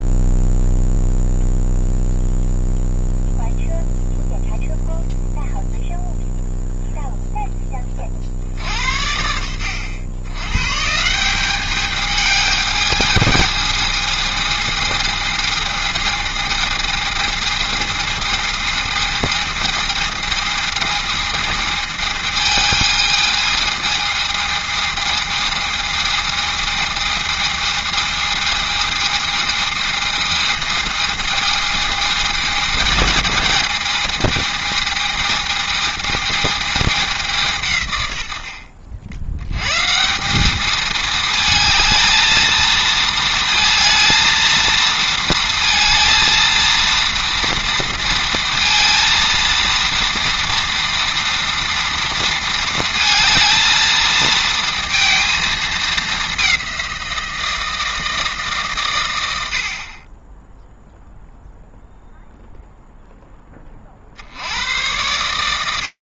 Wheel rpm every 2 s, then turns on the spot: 0, 0, 0, 10, 80, 200, 220, 220, 220, 220, 220, 220, 220, 220, 220, 220, 220, 220, 140, 130, 220, 220, 230, 230, 230, 230, 220, 220, 160, 60, 0, 20, 70.
none